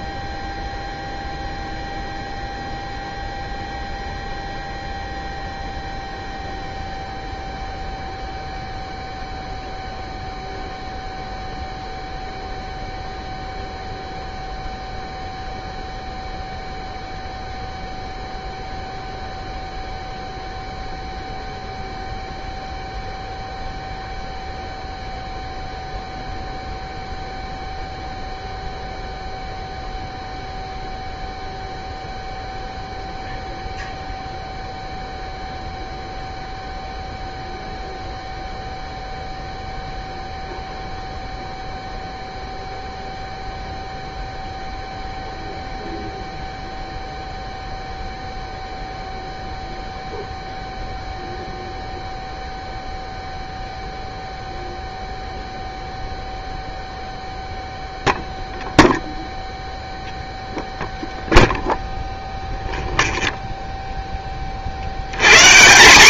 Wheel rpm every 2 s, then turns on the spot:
0, 0, 0, 0, 0, 0, 0, 0, 0, 0, 0, 0, 0, 0, 0, 0, 0, 0, 0, 0, 0, 0, 0, 0, 0, 0, 0, 0, 0, 0, 0, 0, 40.
none